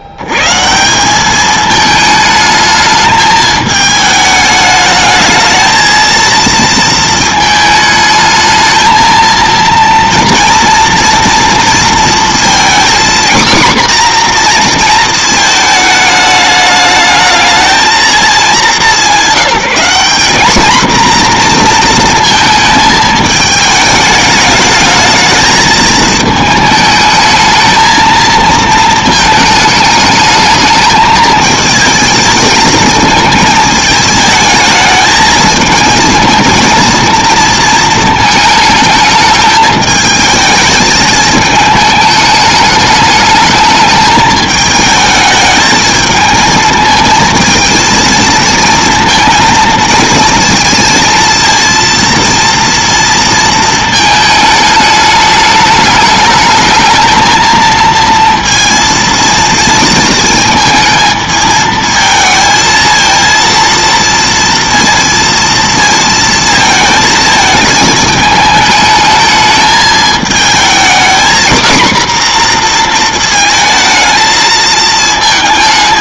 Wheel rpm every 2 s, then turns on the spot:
90, 210, 210, 230, 220, 230, 240, 240, 210, 210, 220, 220, 210, 210, 220, 220, 220, 220, 230, 220, 220, 210, 220, 220, 220, 230, 230, 210, 210, 230, 220, 230, 230, 220, 220, 230, 240, 220.
none